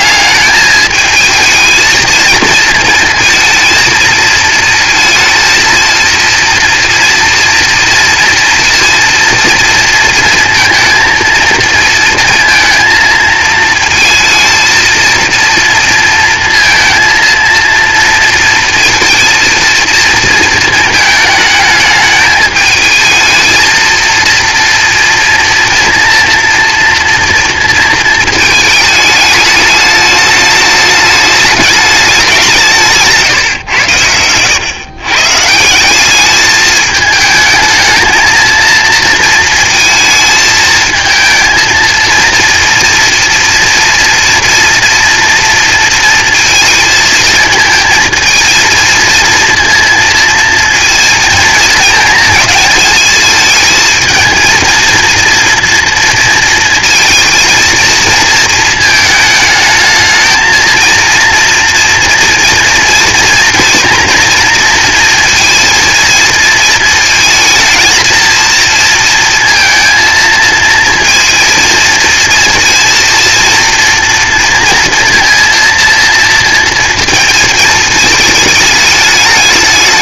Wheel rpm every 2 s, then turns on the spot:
210, 230, 230, 230, 230, 230, 230, 220, 230, 230, 220, 220, 230, 230, 220, 210, 180, 110, 210, 230, 220, 230, 230, 220, 220, 230, 220, 230, 230, 220, 230, 240, 230, 220, 230, 230, 230, 230, 230, 210.
none